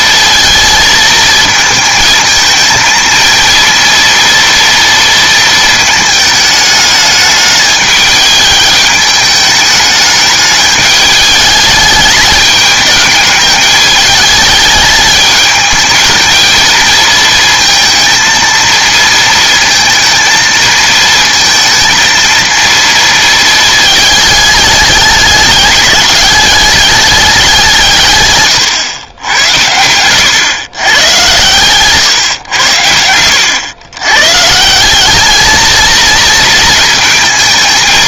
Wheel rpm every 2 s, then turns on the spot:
230, 220, 230, 210, 210, 210, 210, 210, 220, 220, 220, 230, 210, 210, 120, 110, 90, 170, 230.
28-30 32-34